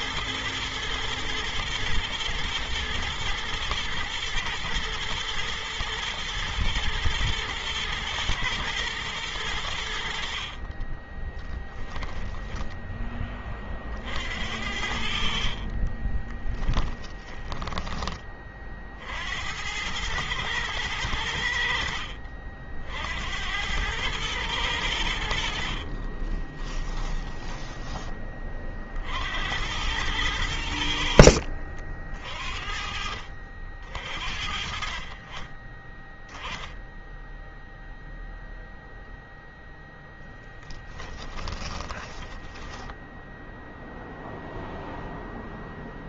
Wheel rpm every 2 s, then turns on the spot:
110, 110, 120, 110, 110, 30, 10, 60, 10, 40, 110, 60, 100, 20, 40, 80, 50, 40, 0, 0, 10, 10, 0.
10-12 16-18 26-28